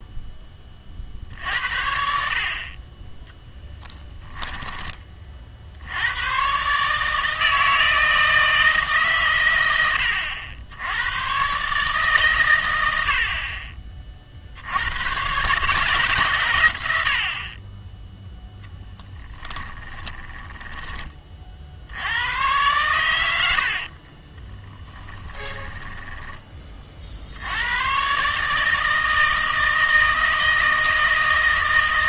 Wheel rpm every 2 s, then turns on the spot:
40, 30, 10, 140, 150, 80, 100, 80, 90, 10, 10, 110, 30, 30, 160, 160.
20-22 24-26